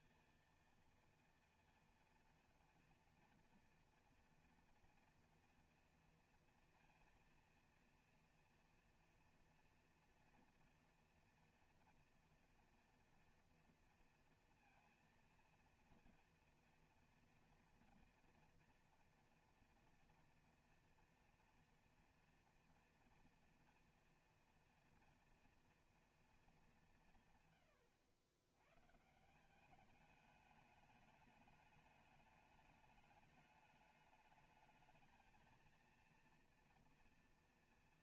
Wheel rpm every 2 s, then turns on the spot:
230, 230, 240, 230, 230, 230, 240, 230, 230, 240, 230, 240, 230, 200, 110, 210, 210, 220, 230.
none